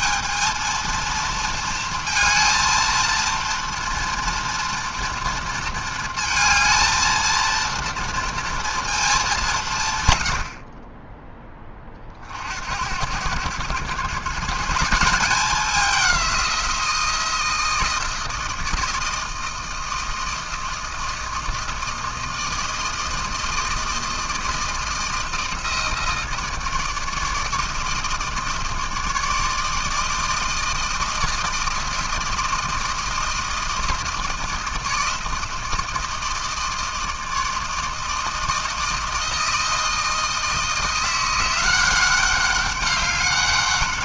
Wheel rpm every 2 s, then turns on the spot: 220, 230, 230, 230, 230, 70, 70, 150, 180, 160, 160, 160, 170, 160, 160, 160, 160, 160, 160, 160, 160, 200.
none